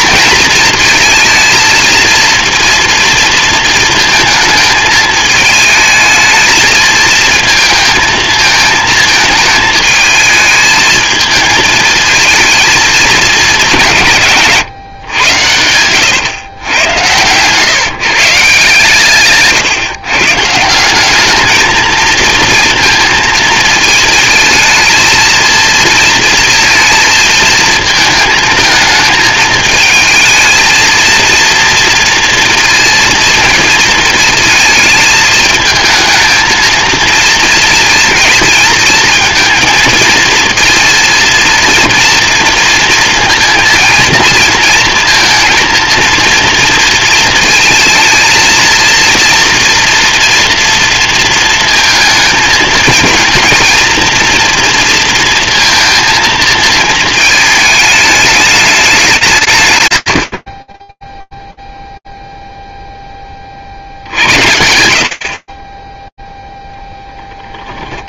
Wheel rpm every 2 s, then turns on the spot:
220, 230, 220, 220, 220, 220, 220, 120, 110, 150, 180, 230, 230, 230, 220, 230, 230, 220, 230, 230, 230, 230, 230, 220, 230, 230, 230, 230, 220, 200, 30, 0, 60, 10.
14-16 66-68